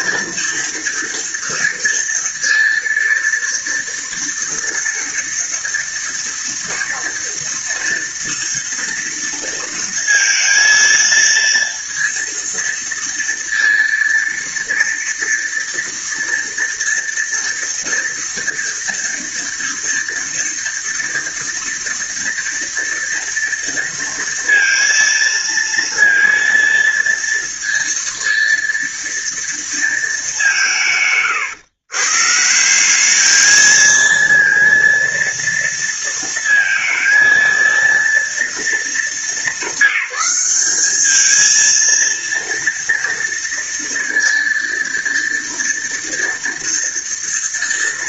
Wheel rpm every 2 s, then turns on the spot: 240, 230, 230, 230, 230, 230, 230, 230, 230, 230, 230, 230, 230, 230, 230, 150, 190, 230, 230, 230, 210, 230, 230, 230.
none